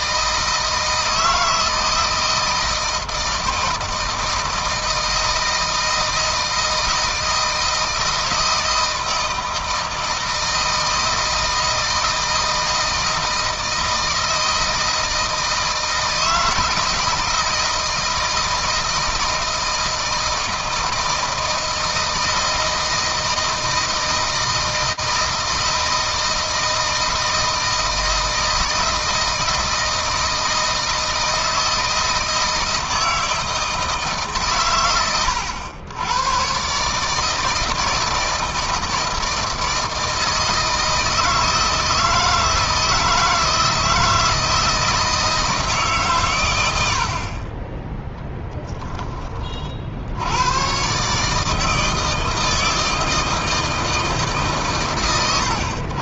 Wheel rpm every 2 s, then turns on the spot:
160, 160, 160, 160, 160, 160, 160, 160, 160, 160, 160, 160, 160, 160, 170, 160, 160, 110, 140, 160, 160, 160, 160, 80, 20, 130, 160, 120.
none